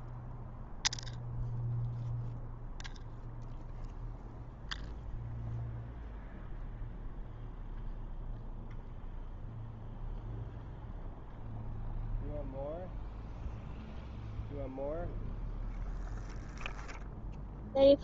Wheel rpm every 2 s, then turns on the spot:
0, 0, 0, 0, 0, 0, 0, 0, 0.
none